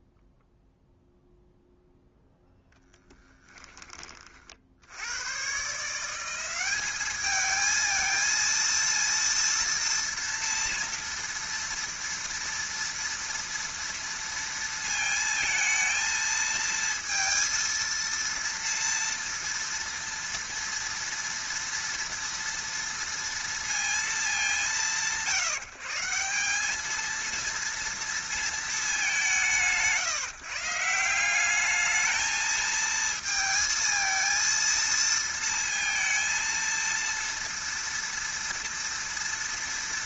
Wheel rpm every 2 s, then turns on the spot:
0, 0, 60, 190, 230, 230, 230, 230, 230, 230, 230, 230, 170, 210, 220, 160, 220, 220, 230, 230.
none